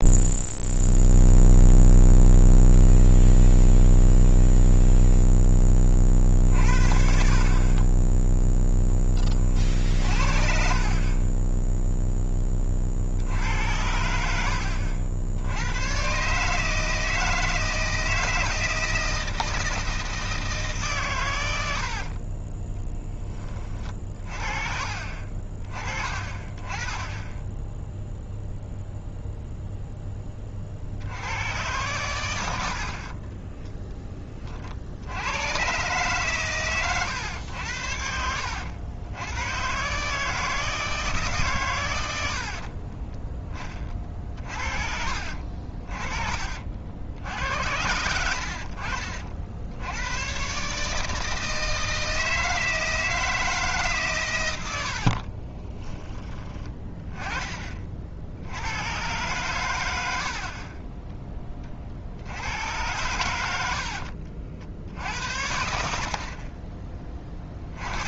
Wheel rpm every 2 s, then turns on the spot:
0, 0, 0, 60, 0, 40, 30, 80, 160, 160, 150, 10, 40, 30, 0, 40, 70, 50, 120, 90, 160, 50, 40, 60, 70, 140, 160, 90, 20, 100, 30, 100, 70, 30.
22-24 42-44 48-50 60-62